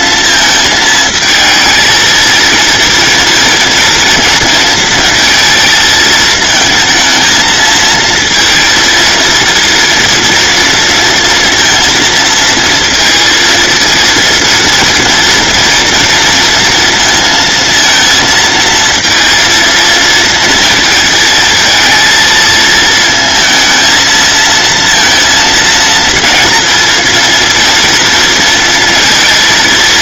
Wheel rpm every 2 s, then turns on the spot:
220, 230, 220, 220, 230, 230, 230, 230, 230, 230, 220, 220, 230, 230, 230.
none